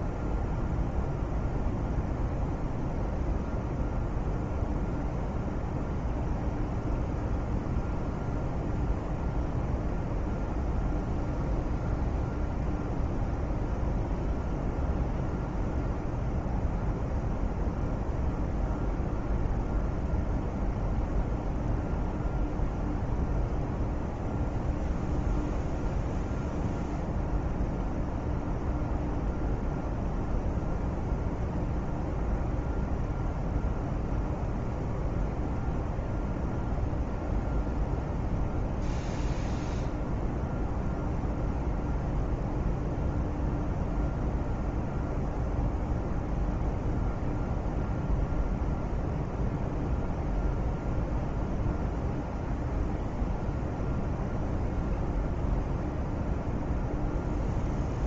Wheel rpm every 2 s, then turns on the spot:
0, 0, 0, 0, 0, 0, 0, 0, 0, 0, 0, 0, 0, 0, 0, 0, 0, 0, 0, 0, 0, 0, 0, 0, 0, 0, 0, 0, 0.
none